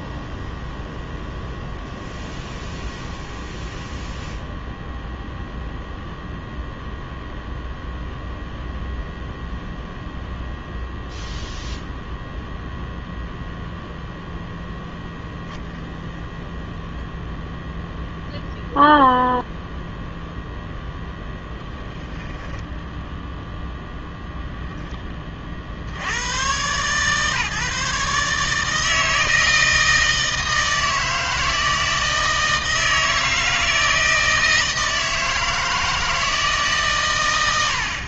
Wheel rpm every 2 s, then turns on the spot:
0, 0, 0, 0, 0, 0, 0, 0, 0, 0, 0, 0, 0, 120, 150, 160, 160, 160, 150.
none